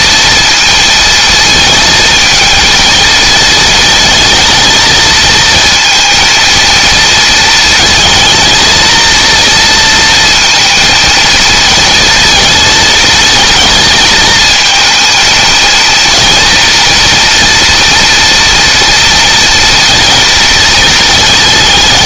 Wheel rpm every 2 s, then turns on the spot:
220, 230, 230, 230, 230, 230, 220, 220, 230, 230, 220.
none